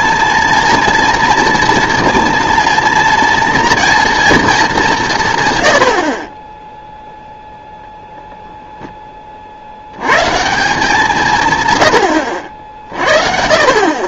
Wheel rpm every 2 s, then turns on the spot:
230, 230, 210, 10, 0, 170, 60.
none